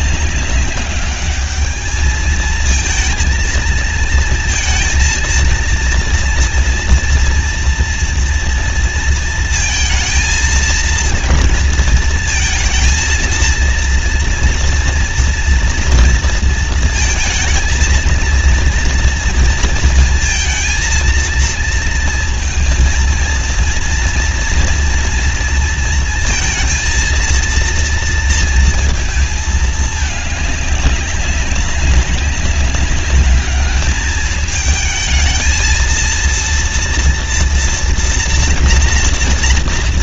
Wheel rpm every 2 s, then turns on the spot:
200, 230, 230, 230, 230, 230, 220, 230, 230, 230, 230, 220, 230, 230, 230, 200, 190, 220, 230, 230.
none